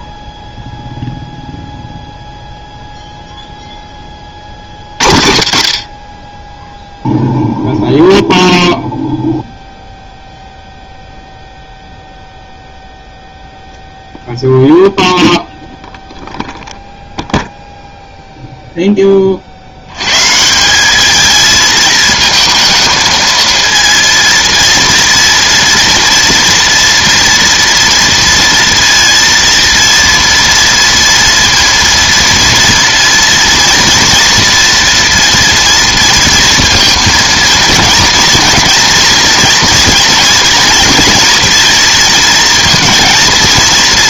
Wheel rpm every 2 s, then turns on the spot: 0, 0, 40, 10, 0, 0, 0, 0, 0, 0, 180, 220, 230, 230, 230, 230, 230, 230, 230, 230, 230, 230.
none